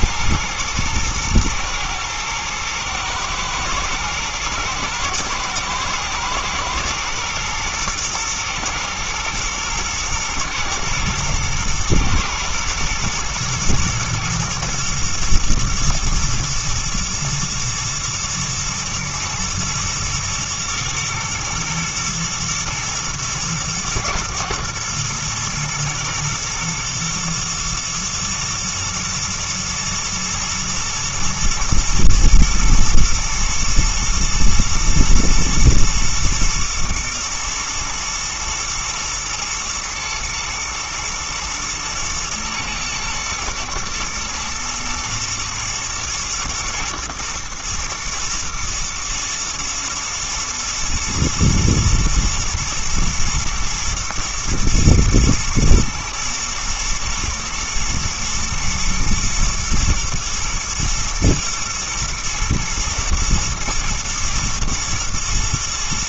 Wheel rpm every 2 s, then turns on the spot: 120, 110, 110, 110, 120, 120, 120, 120, 120, 110, 120, 110, 110, 120, 120, 110, 110, 120, 110, 110, 110, 110, 110, 120, 120, 120, 110, 120, 120, 110, 110, 120, 120.
none